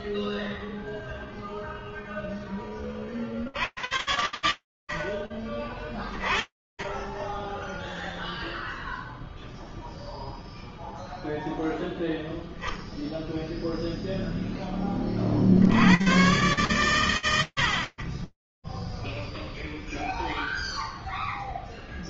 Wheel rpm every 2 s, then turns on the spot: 0, 70, 20, 0, 0, 0, 10, 120, 30, 0, 0.
none